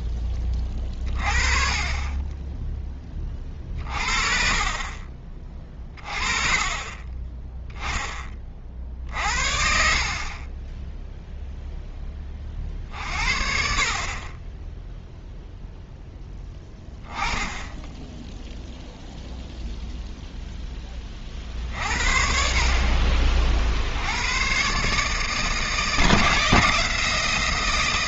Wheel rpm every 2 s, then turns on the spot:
30, 10, 40, 30, 40, 20, 40, 10, 10, 0, 10, 40, 130, 150.
none